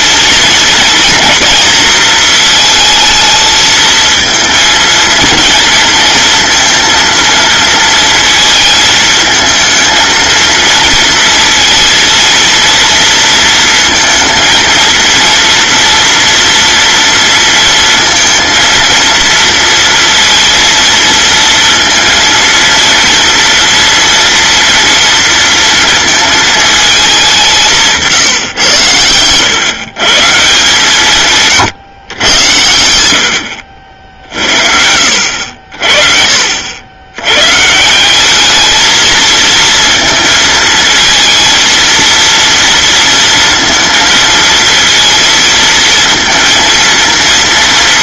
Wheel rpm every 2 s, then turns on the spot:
230, 220, 230, 230, 220, 230, 230, 230, 230, 230, 230, 230, 230, 220, 110, 160, 90, 70, 80, 220, 230, 230, 230, 230.
none